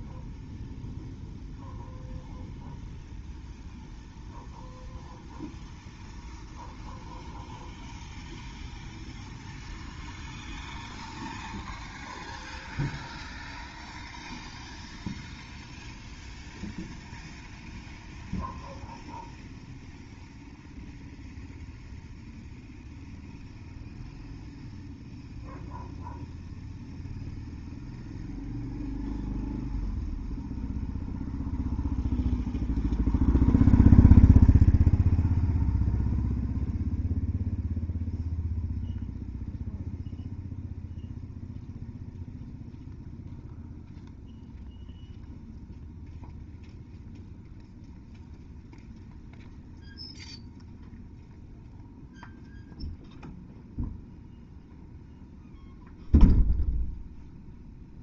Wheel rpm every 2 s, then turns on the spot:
0, 0, 0, 0, 0, 0, 0, 0, 0, 0, 0, 0, 0, 0, 0, 0, 0, 0, 0, 0, 0, 0, 0, 0, 0, 0, 0, 0, 0.
none